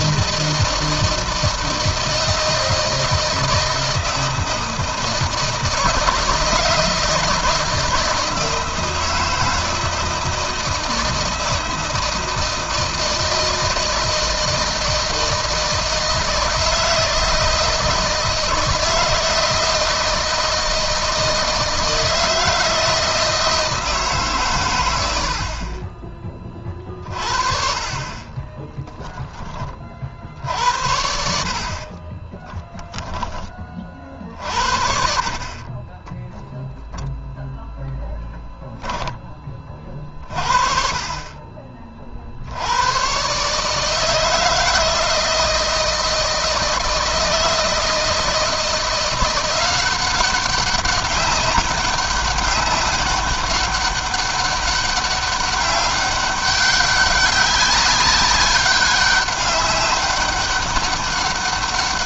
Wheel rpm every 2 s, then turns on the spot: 160, 160, 160, 160, 160, 160, 160, 160, 160, 160, 160, 160, 100, 40, 20, 70, 10, 60, 0, 10, 40, 110, 160, 160, 170, 200, 200, 200, 200, 200, 200.
28-30